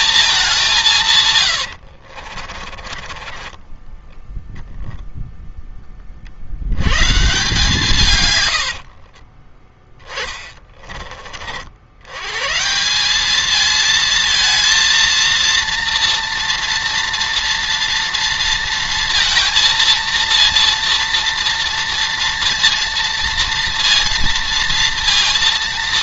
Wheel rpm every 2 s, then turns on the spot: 200, 50, 0, 90, 80, 20, 150, 230, 230, 230, 230, 230, 230.
2-4 8-10